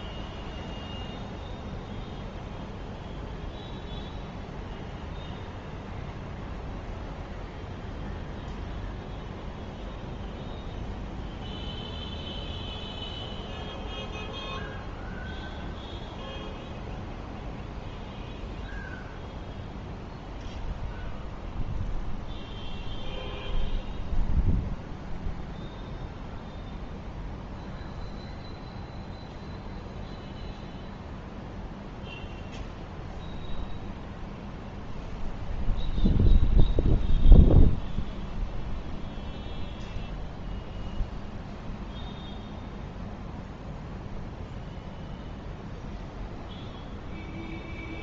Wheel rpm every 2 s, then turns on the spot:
0, 0, 0, 0, 0, 0, 0, 0, 0, 0, 0, 0, 0, 0, 0, 0, 0, 0, 0, 0, 0, 0, 0, 0.
none